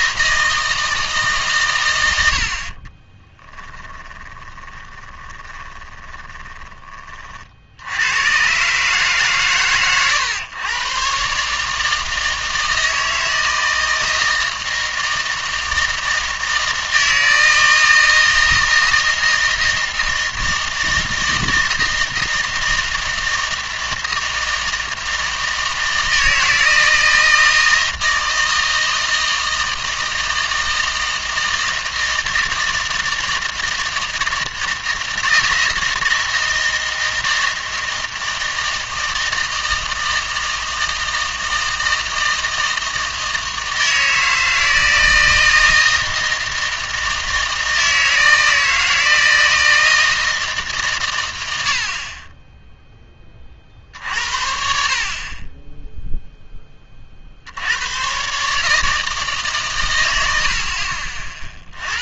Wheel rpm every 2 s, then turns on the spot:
160, 40, 20, 20, 140, 120, 160, 160, 160, 160, 160, 160, 160, 160, 160, 160, 160, 160, 160, 160, 160, 160, 160, 160, 160, 150, 10, 60, 20, 150, 70.
4-8